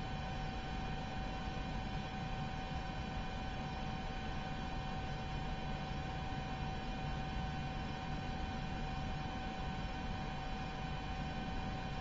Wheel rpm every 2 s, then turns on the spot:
0, 0, 0, 0, 0, 0.
none